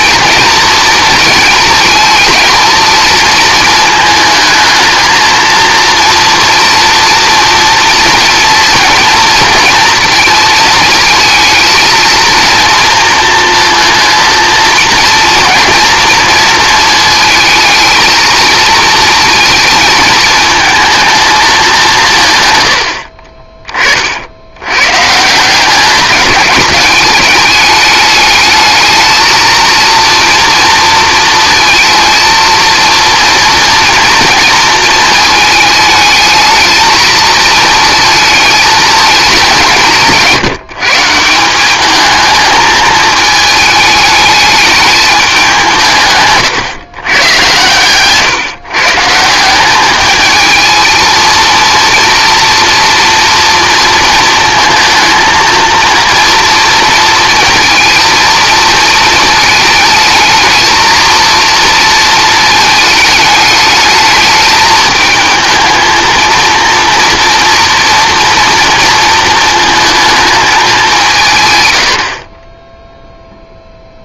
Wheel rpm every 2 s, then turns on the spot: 230, 220, 220, 230, 230, 220, 230, 230, 230, 230, 220, 80, 120, 200, 220, 230, 230, 230, 220, 220, 160, 220, 210, 120, 150, 230, 230, 230, 230, 220, 220, 220, 220, 230, 230, 190, 0.
22-24